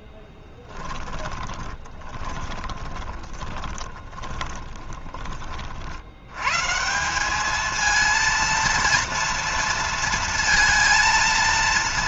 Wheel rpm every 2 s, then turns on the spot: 10, 20, 30, 160, 230, 230.
0-6